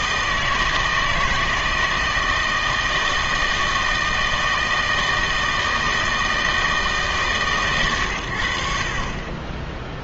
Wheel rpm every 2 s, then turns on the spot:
160, 160, 160, 160, 60.
none